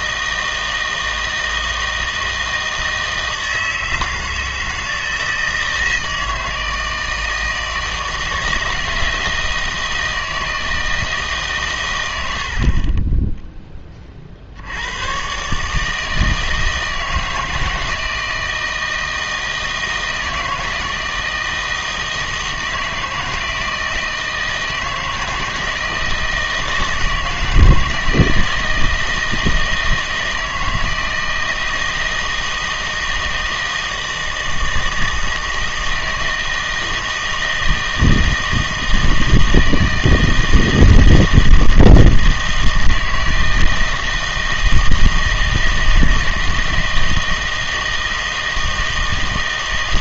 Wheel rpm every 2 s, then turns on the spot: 160, 160, 160, 160, 160, 160, 50, 70, 160, 160, 160, 160, 160, 160, 160, 160, 160, 160, 160, 160, 160, 160, 160, 160, 160.
12-14